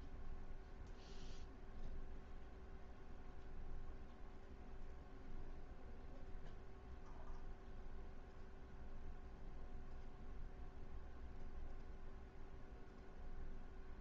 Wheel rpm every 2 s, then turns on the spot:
0, 0, 0, 0, 0, 0, 0.
none